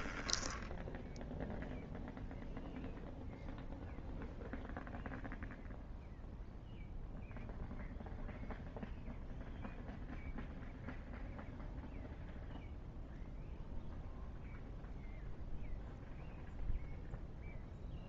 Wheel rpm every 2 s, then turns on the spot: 0, 0, 0, 0, 0, 0, 0, 0, 0.
none